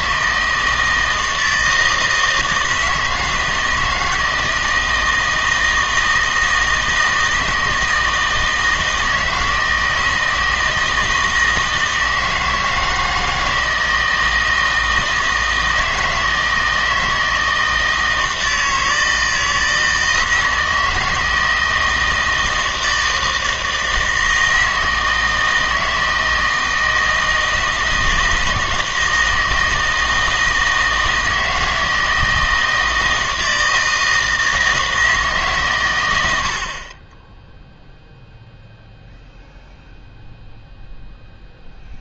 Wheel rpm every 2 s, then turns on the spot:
160, 160, 160, 160, 160, 160, 160, 160, 160, 160, 160, 160, 160, 160, 160, 160, 160, 160, 70, 0, 0.
none